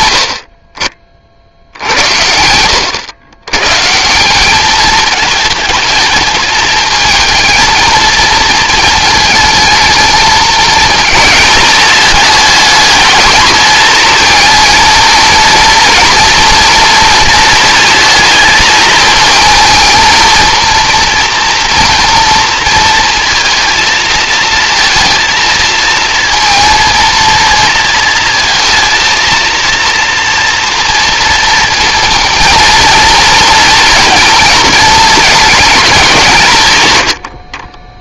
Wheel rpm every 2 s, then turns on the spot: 60, 90, 210, 220, 220, 230, 210, 230, 230, 220, 230, 230, 230, 230, 230, 230, 230, 220, 120.
none